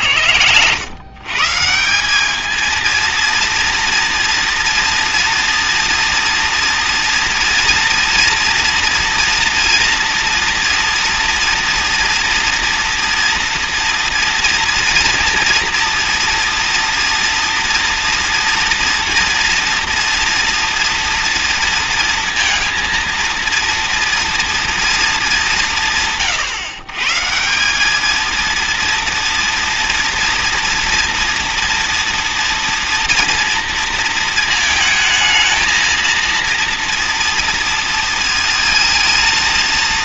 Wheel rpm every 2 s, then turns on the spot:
100, 210, 230, 240, 230, 230, 230, 230, 240, 230, 230, 230, 230, 130, 230, 230, 230, 220, 230, 230.
none